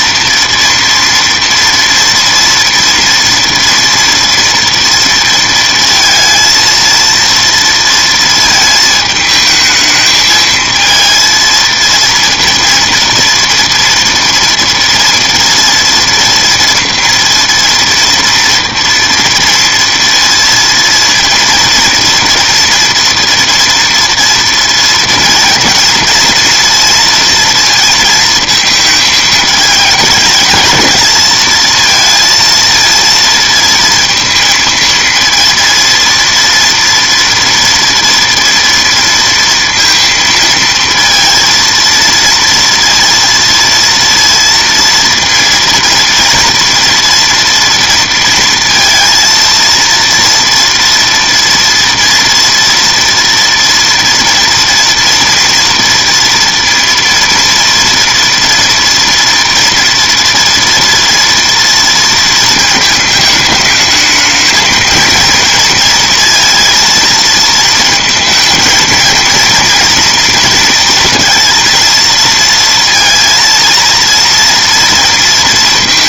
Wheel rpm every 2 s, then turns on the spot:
230, 230, 230, 230, 220, 220, 230, 230, 230, 230, 230, 230, 230, 230, 220, 220, 230, 230, 230, 240, 230, 230, 230, 230, 230, 230, 230, 230, 230, 240, 230, 220, 230, 230, 230, 230, 230, 230.
none